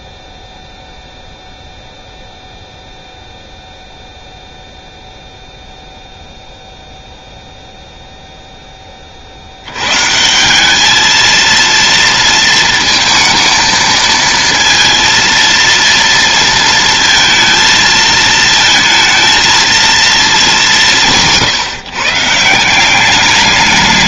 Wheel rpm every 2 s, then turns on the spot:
0, 0, 0, 0, 10, 190, 230, 230, 230, 220, 210, 170.
none